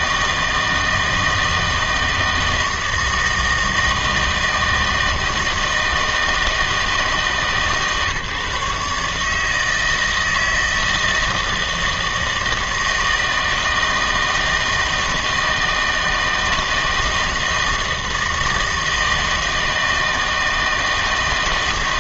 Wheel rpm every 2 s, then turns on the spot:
160, 160, 160, 160, 140, 160, 160, 160, 160, 160, 160.
none